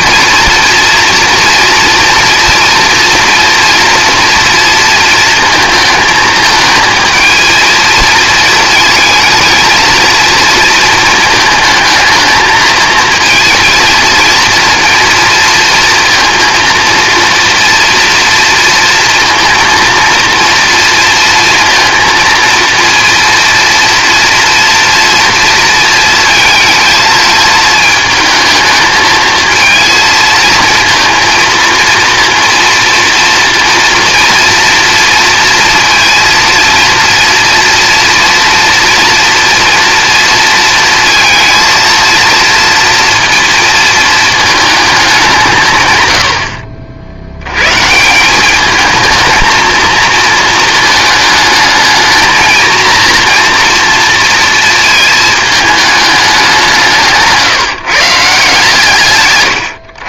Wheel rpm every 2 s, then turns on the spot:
230, 230, 230, 220, 220, 230, 230, 230, 230, 230, 230, 230, 230, 220, 220, 230, 230, 230, 230, 230, 230, 230, 220, 60, 200, 220, 220, 230, 180, 150.
none